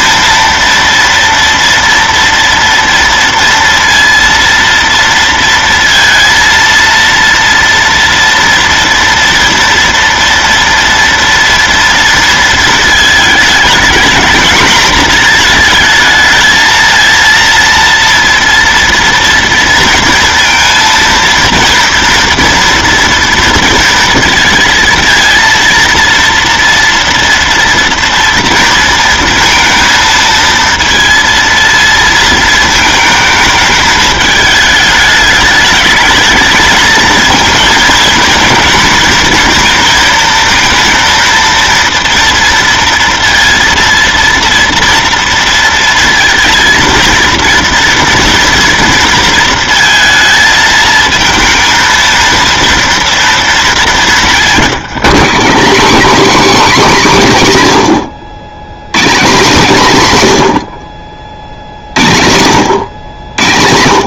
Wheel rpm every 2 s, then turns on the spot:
230, 230, 230, 230, 230, 230, 220, 230, 220, 230, 230, 240, 230, 230, 230, 230, 220, 210, 220, 230, 230, 230, 230, 230, 230, 220, 230, 190, 270, 130, 100, 110.
none